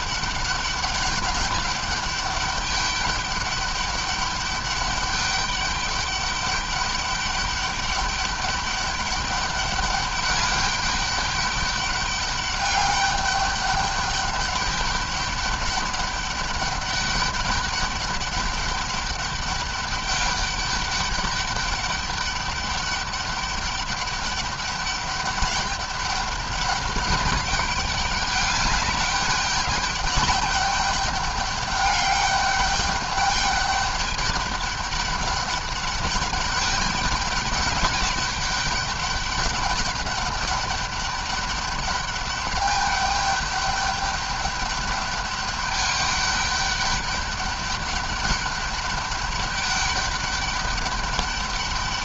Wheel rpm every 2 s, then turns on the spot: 200, 200, 200, 200, 200, 210, 200, 200, 200, 200, 200, 200, 200, 200, 200, 200, 200, 200, 210, 200, 200, 210, 200, 200, 200, 200.
none